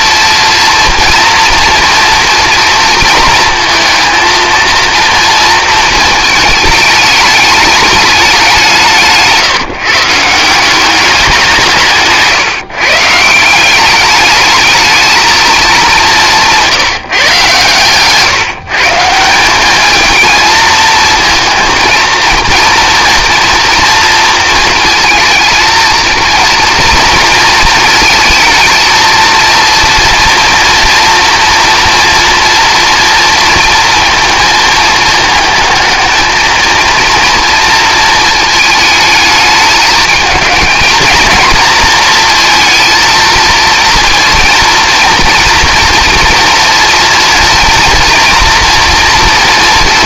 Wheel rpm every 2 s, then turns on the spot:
230, 230, 230, 220, 190, 170, 150, 210, 180, 150, 230, 230, 230, 230, 220, 230, 230, 220, 220, 220, 220, 230, 230, 230, 230.
none